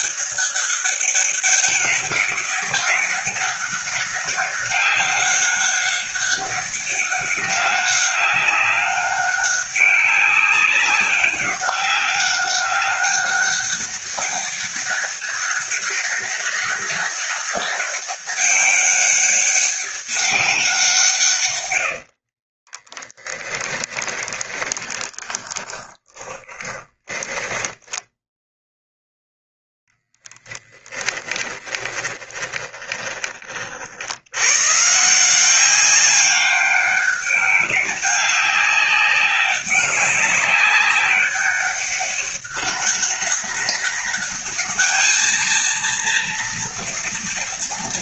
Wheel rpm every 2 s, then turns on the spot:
200, 200, 200, 200, 200, 200, 200, 200, 200, 200, 190, 20, 20, 20, 0, 20, 30, 130, 200, 190, 200, 200, 220, 230.
22-28 30-34